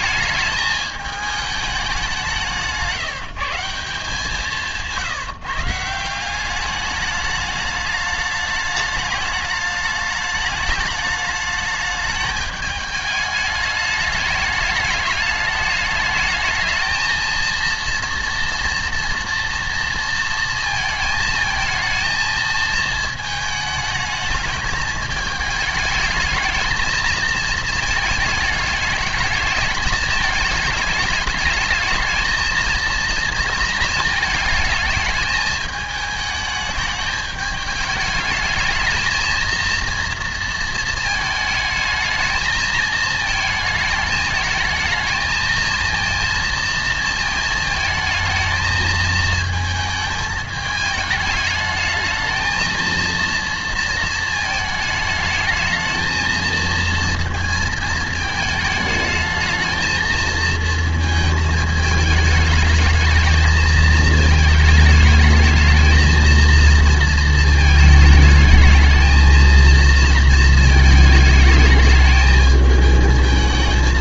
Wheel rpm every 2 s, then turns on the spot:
210, 170, 160, 200, 210, 210, 210, 210, 220, 230, 230, 230, 220, 220, 220, 220, 230, 220, 210, 210, 230, 220, 220, 230, 220, 220, 220, 220, 230, 220, 220, 210, 220, 230, 220, 230, 220.
4-6